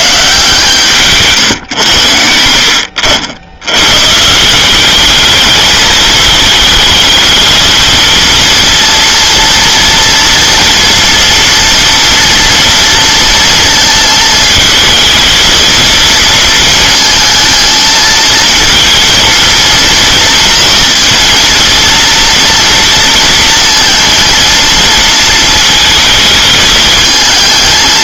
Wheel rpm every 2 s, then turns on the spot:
160, 70, 190, 220, 230, 230, 230, 230, 220, 230, 230, 230, 230, 220.
none